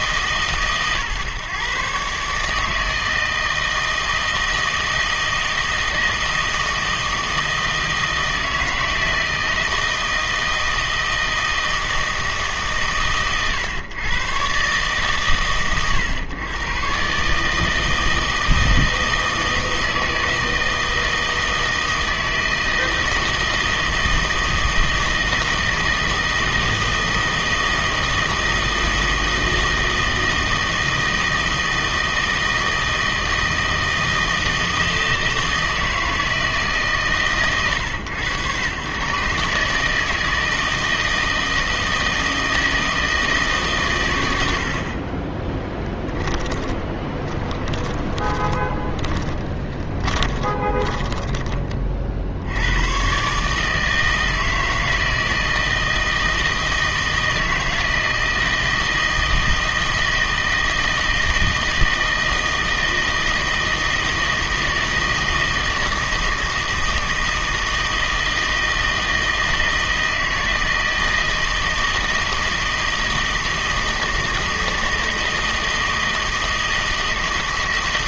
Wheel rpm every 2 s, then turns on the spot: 140, 150, 160, 160, 160, 160, 140, 130, 120, 160, 160, 160, 160, 160, 160, 160, 160, 160, 150, 110, 160, 160, 60, 20, 20, 20, 100, 160, 160, 160, 160, 160, 160, 160, 160, 160, 160, 160, 160.
46-52